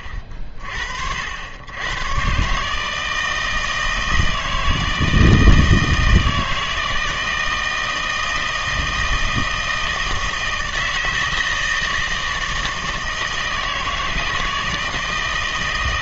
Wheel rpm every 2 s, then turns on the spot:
50, 160, 160, 160, 160, 160, 160, 160.
none